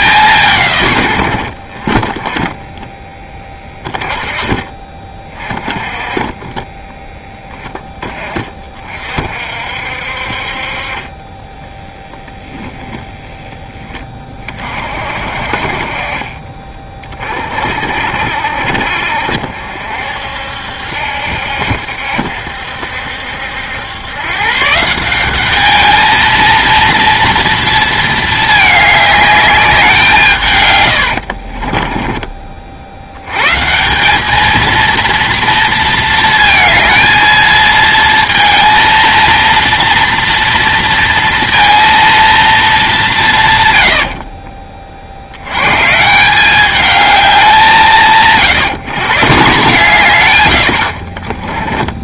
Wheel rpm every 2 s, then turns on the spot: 140, 10, 20, 20, 30, 40, 10, 30, 30, 60, 70, 70, 150, 230, 210, 120, 50, 220, 230, 230, 230, 210, 40, 200, 150, 90.
none